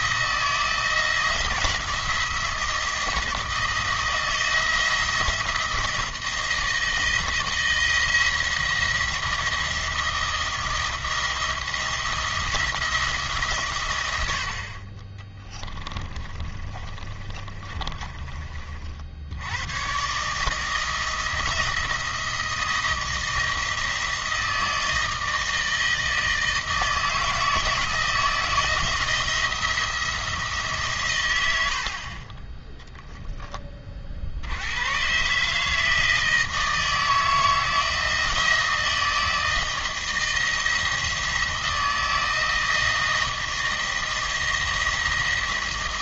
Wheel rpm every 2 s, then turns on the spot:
160, 170, 170, 160, 170, 160, 170, 50, 30, 50, 160, 160, 160, 160, 160, 150, 10, 100, 160, 160, 170, 160, 170.
16-18